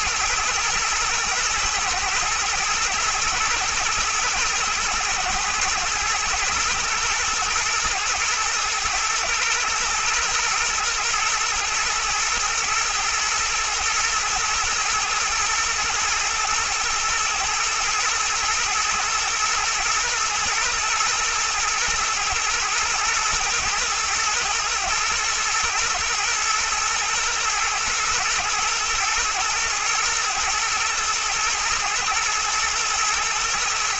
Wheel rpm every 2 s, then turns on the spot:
120, 120, 110, 110, 110, 120, 120, 110, 120, 120, 120, 120, 120, 120, 120, 110, 110.
none